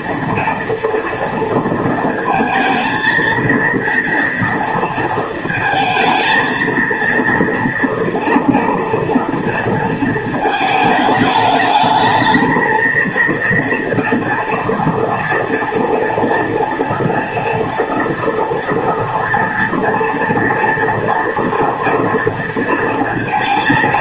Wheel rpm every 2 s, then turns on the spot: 230, 230, 230, 230, 230, 220, 220, 230, 230, 230, 230, 230.
none